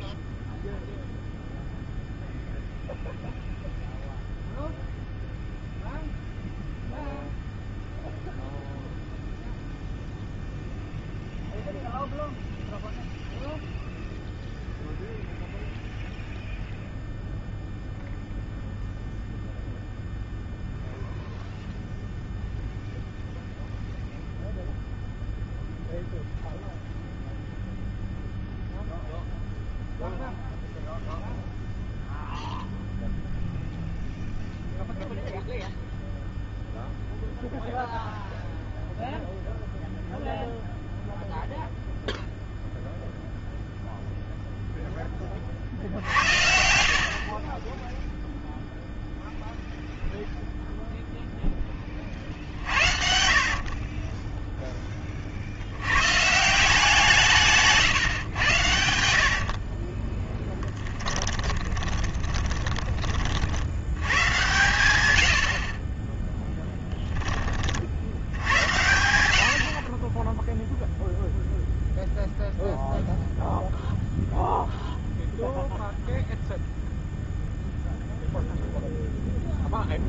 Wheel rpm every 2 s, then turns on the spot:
0, 0, 0, 0, 0, 0, 0, 0, 0, 0, 0, 0, 0, 0, 0, 0, 0, 0, 0, 0, 0, 0, 0, 70, 0, 0, 60, 10, 170, 80, 10, 20, 130, 10, 100, 0, 0, 0, 0, 0.
46-48 52-54 58-62